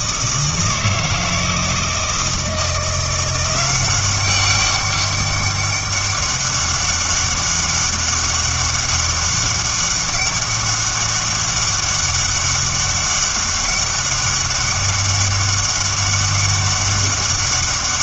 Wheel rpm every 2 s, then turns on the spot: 160, 160, 200, 200, 200, 200, 200, 200, 200.
none